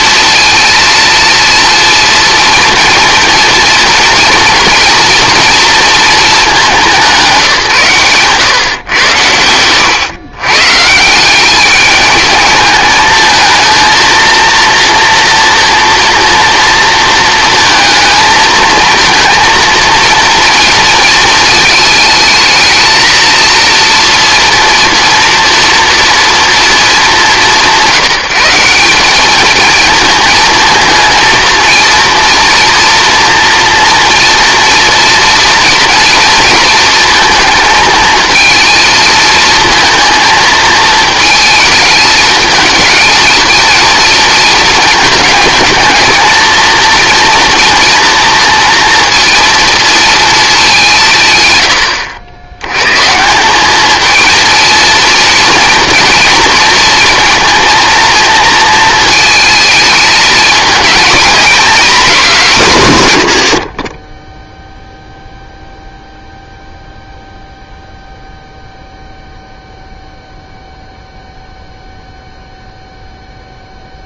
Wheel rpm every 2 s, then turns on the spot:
230, 230, 230, 210, 120, 140, 210, 230, 230, 220, 230, 220, 230, 220, 180, 220, 230, 230, 230, 230, 220, 220, 230, 230, 230, 200, 110, 230, 230, 220, 220, 200, 0, 0, 0, 0, 0.
8-10